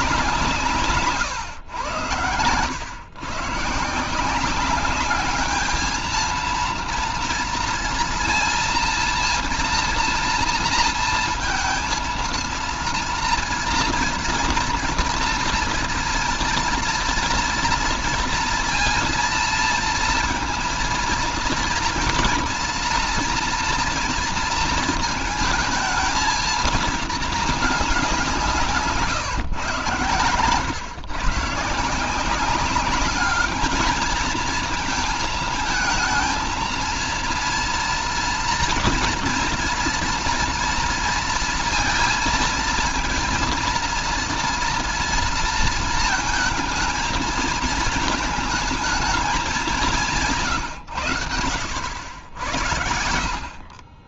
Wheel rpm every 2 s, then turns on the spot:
150, 100, 190, 230, 230, 230, 230, 240, 230, 230, 230, 240, 230, 220, 160, 130, 200, 220, 230, 240, 240, 230, 230, 220, 220, 130, 70.
28-30